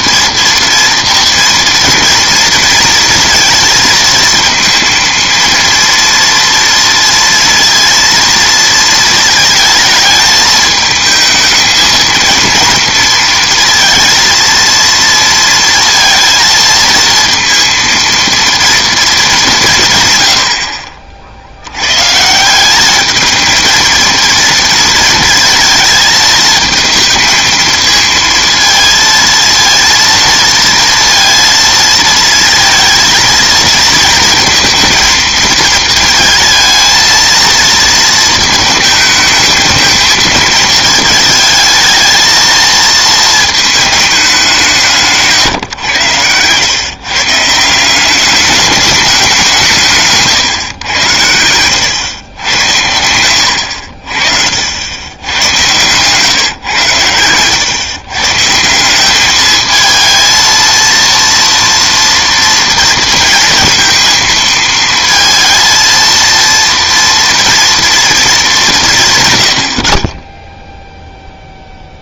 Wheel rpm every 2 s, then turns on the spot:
230, 230, 230, 230, 230, 220, 230, 220, 230, 230, 60, 190, 230, 220, 230, 230, 230, 230, 220, 220, 220, 220, 180, 120, 210, 130, 100, 70, 130, 160, 230, 230, 220, 230, 190, 0.
52-54